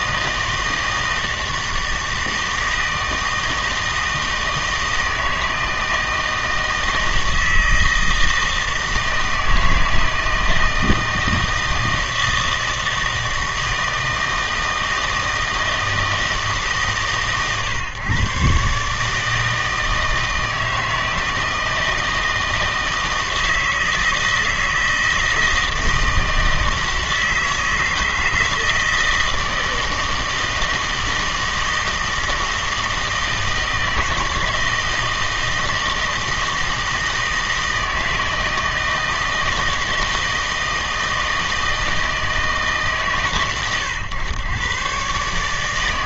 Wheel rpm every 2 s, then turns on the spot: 160, 160, 160, 160, 160, 160, 160, 160, 150, 140, 160, 160, 160, 160, 160, 160, 160, 160, 160, 160, 160, 150, 110.
none